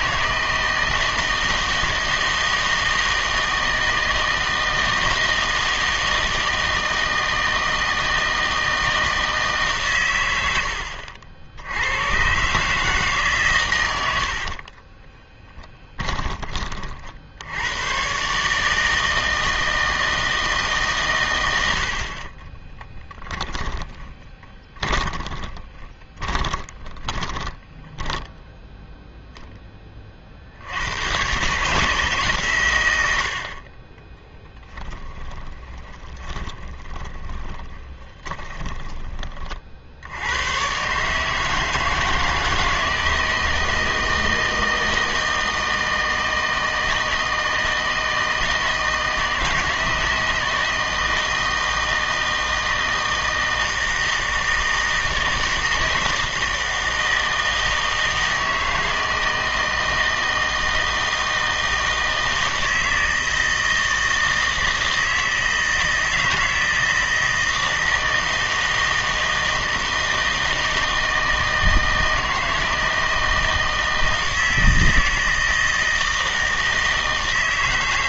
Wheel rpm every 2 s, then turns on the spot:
160, 160, 160, 160, 160, 90, 140, 50, 30, 150, 160, 20, 20, 20, 0, 80, 120, 10, 20, 20, 110, 160, 160, 160, 160, 160, 160, 160, 160, 160, 160, 160, 160, 160, 160, 160, 160, 160, 160.
14-16 22-28 36-40